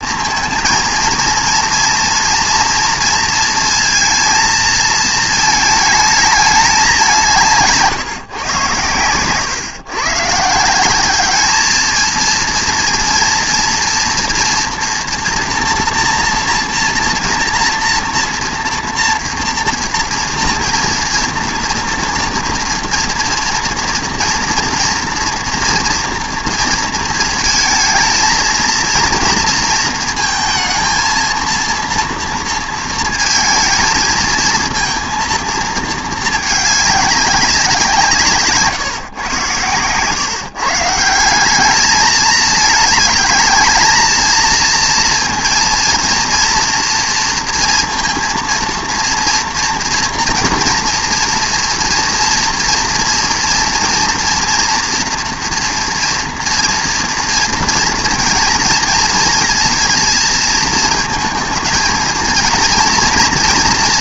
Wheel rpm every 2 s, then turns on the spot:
230, 230, 230, 200, 110, 160, 230, 230, 230, 230, 230, 230, 240, 230, 220, 230, 230, 230, 210, 150, 160, 220, 230, 240, 230, 230, 240, 230, 230, 230, 230, 230.
none